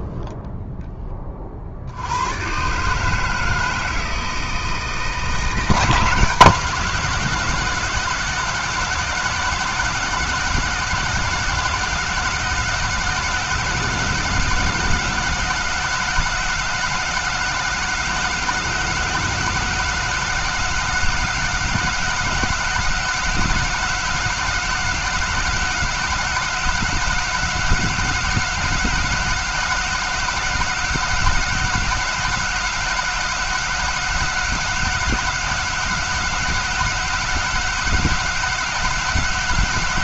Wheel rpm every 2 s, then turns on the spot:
0, 120, 160, 170, 180, 180, 180, 190, 180, 190, 190, 190, 190, 190, 190, 190, 190, 190, 190, 190.
none